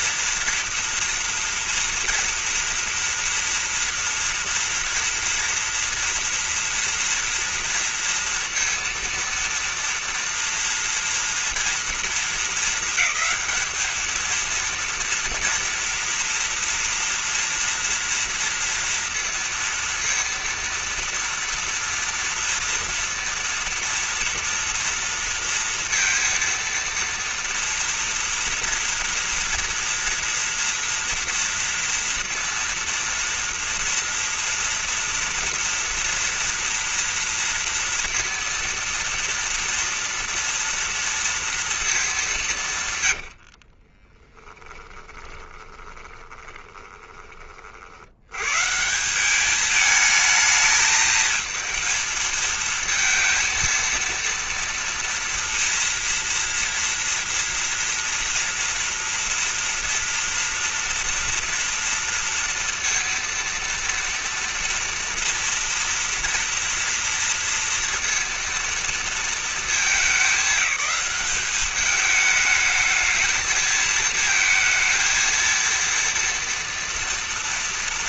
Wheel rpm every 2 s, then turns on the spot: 240, 230, 230, 240, 230, 230, 220, 230, 230, 230, 230, 230, 240, 230, 230, 240, 230, 230, 230, 230, 230, 180, 10, 20, 120, 220, 230, 230, 230, 230, 230, 230, 230, 230, 230, 200, 220, 220, 230.
44-48